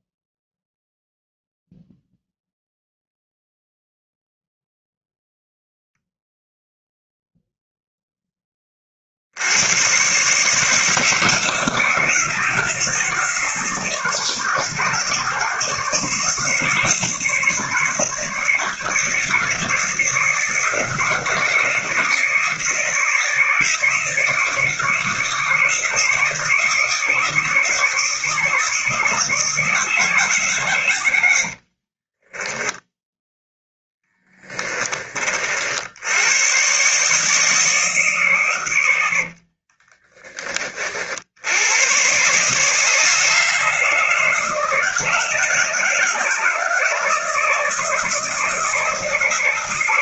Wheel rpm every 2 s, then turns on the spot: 0, 0, 0, 0, 40, 170, 160, 140, 160, 160, 160, 160, 150, 160, 160, 110, 10, 30, 140, 90, 50, 150, 170, 160, 160.
30-34 38-40